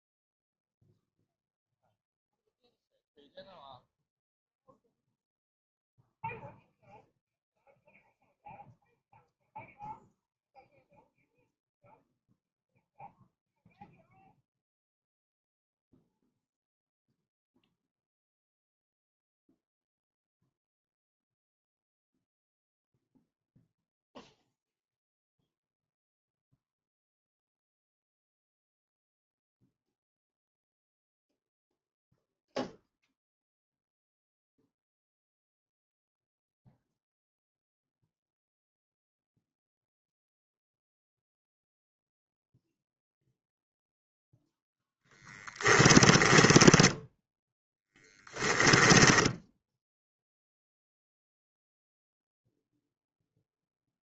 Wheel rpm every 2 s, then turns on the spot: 0, 0, 0, 0, 0, 0, 0, 0, 0, 0, 0, 0, 0, 0, 0, 0, 0, 0, 0, 0, 0, 0, 0, 10, 10, 0, 0.
46-50